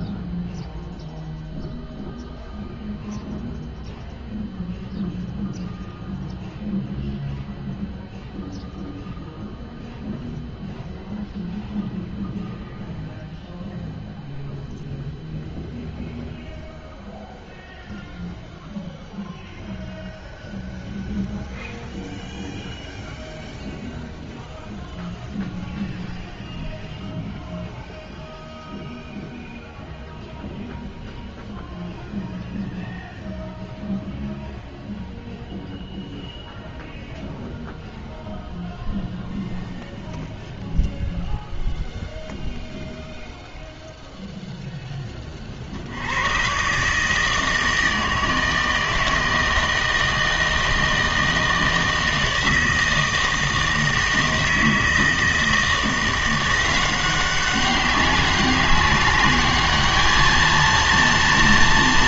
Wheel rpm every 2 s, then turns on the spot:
0, 0, 0, 0, 0, 0, 0, 0, 0, 0, 0, 0, 0, 0, 0, 0, 0, 0, 0, 0, 0, 0, 0, 130, 160, 160, 160, 160, 180, 190, 230.
none